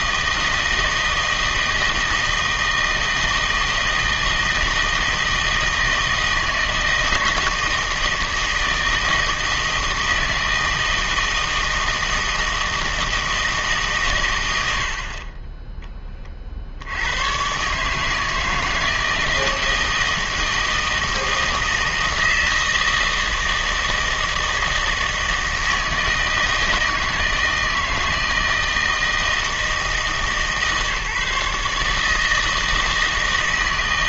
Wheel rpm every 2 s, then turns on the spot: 160, 160, 160, 160, 160, 160, 160, 70, 70, 160, 160, 160, 160, 160, 160, 150, 160.
none